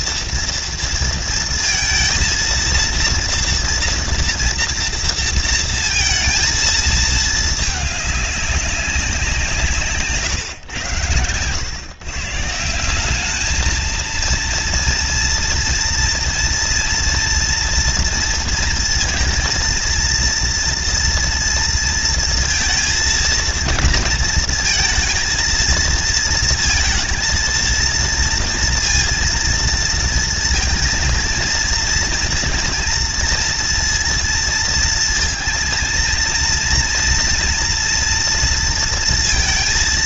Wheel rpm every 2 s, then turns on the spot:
230, 230, 230, 230, 200, 140, 150, 230, 230, 230, 230, 230, 230, 230, 230, 230, 240, 230, 230, 230.
none